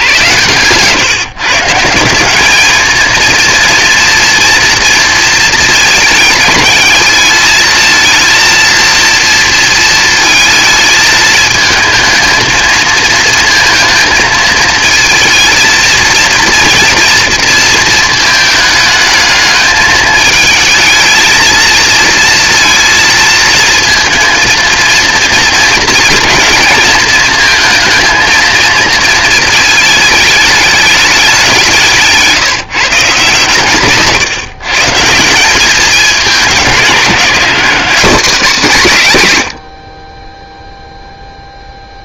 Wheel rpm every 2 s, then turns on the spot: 110, 200, 230, 210, 230, 220, 220, 220, 230, 220, 220, 230, 230, 220, 230, 210, 170, 140, 190, 200, 10.
none